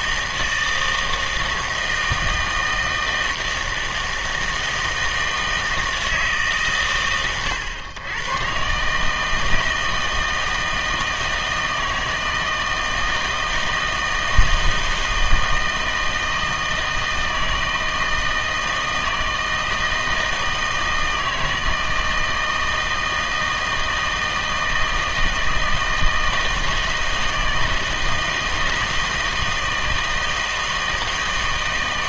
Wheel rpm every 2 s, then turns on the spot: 160, 160, 160, 140, 130, 160, 160, 160, 160, 160, 160, 160, 160, 160, 160, 160.
none